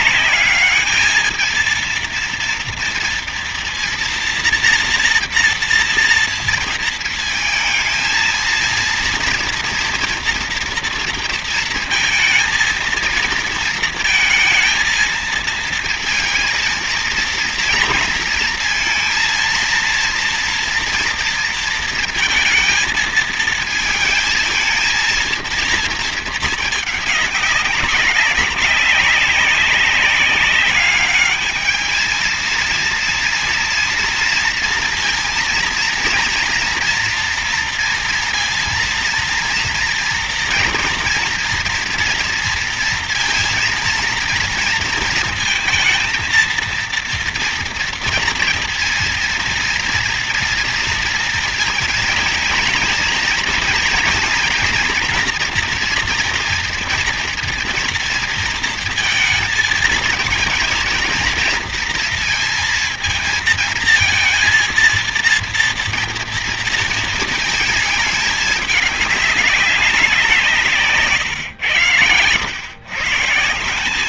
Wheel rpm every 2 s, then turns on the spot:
210, 230, 230, 230, 230, 230, 220, 220, 230, 230, 230, 230, 230, 210, 190, 200, 220, 230, 230, 230, 230, 230, 230, 230, 230, 230, 230, 240, 230, 230, 230, 230, 230, 230, 210, 160, 110.
none